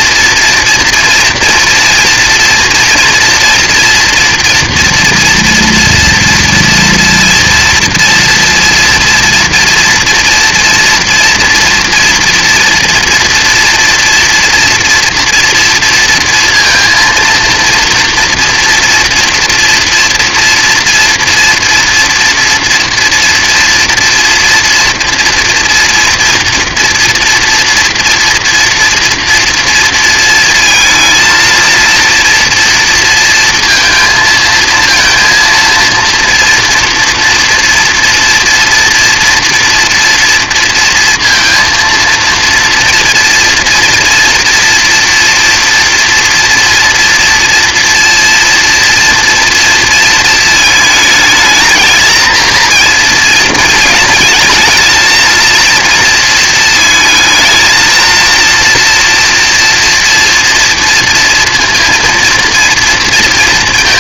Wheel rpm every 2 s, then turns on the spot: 230, 230, 240, 230, 240, 230, 230, 240, 230, 230, 230, 230, 230, 230, 230, 220, 230, 230, 230, 230, 230, 230, 230, 230, 230, 220, 230, 220, 230, 230, 230, 230.
none